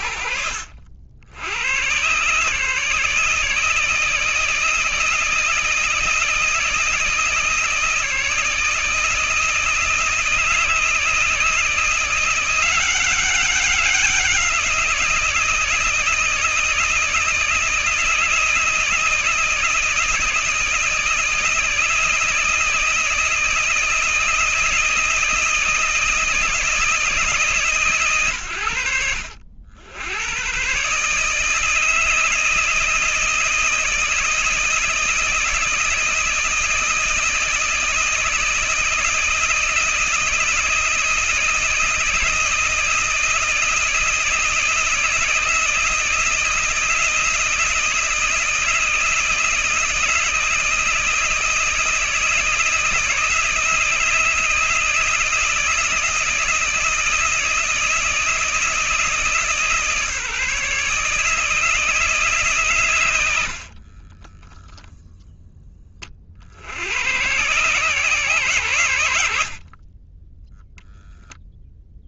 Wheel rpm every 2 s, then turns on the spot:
70, 160, 160, 160, 160, 160, 190, 170, 160, 160, 160, 160, 160, 160, 70, 150, 160, 160, 160, 160, 160, 160, 160, 160, 160, 160, 160, 160, 160, 160, 150, 110, 0, 100, 100, 0.
none